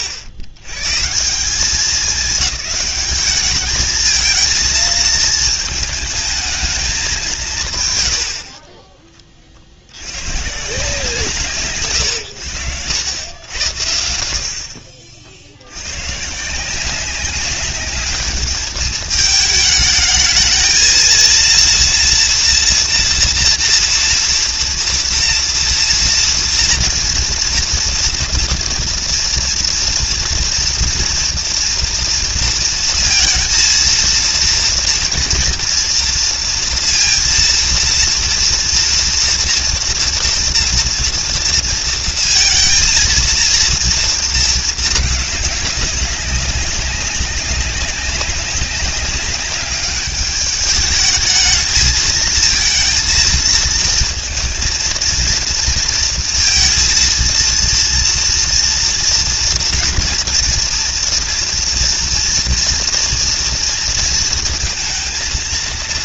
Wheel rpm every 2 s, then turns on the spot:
60, 190, 220, 210, 20, 150, 100, 40, 160, 210, 220, 230, 230, 230, 230, 230, 230, 230, 230, 230, 240, 230, 220, 200, 190, 210, 220, 230, 230, 230, 230, 240, 230.
none